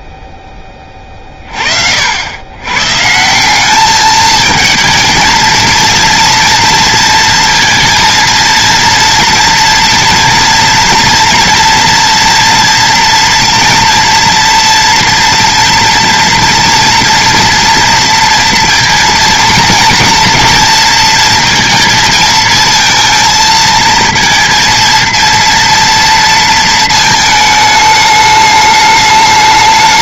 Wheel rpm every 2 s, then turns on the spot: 20, 120, 220, 230, 230, 240, 230, 230, 230, 230, 230, 220, 230, 230, 210.
none